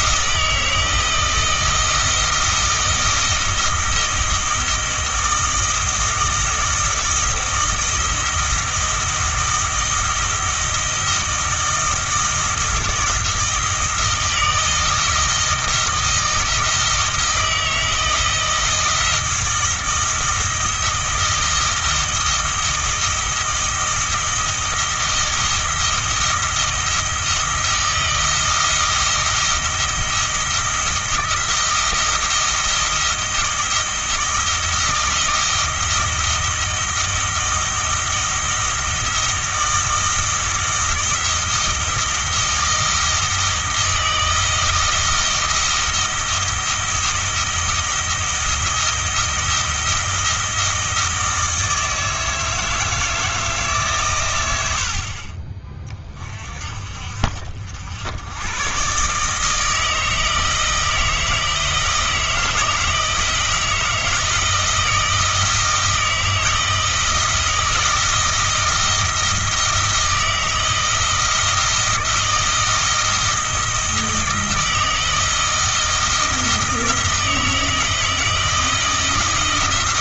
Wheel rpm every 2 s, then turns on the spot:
160, 160, 160, 160, 170, 160, 160, 160, 160, 160, 170, 160, 160, 160, 160, 160, 170, 160, 160, 160, 160, 160, 160, 170, 170, 160, 160, 80, 40, 120, 160, 160, 160, 160, 160, 160, 160, 160, 160, 160.
none